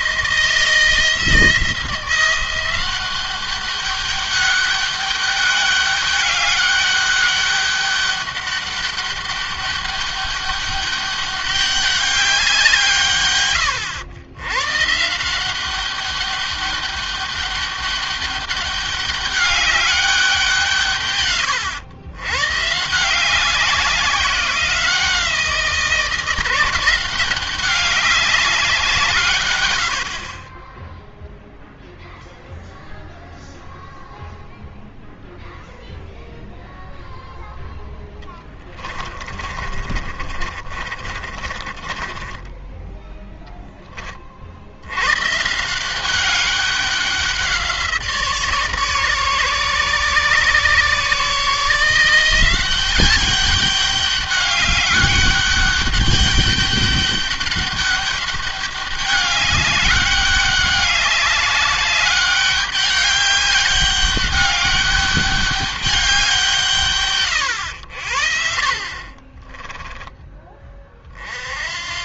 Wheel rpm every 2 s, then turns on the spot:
170, 180, 200, 200, 200, 200, 160, 130, 200, 200, 160, 140, 180, 170, 180, 20, 0, 0, 0, 20, 40, 10, 80, 200, 150, 140, 180, 200, 200, 200, 200, 200, 200, 160, 40, 20.
38-42 68-70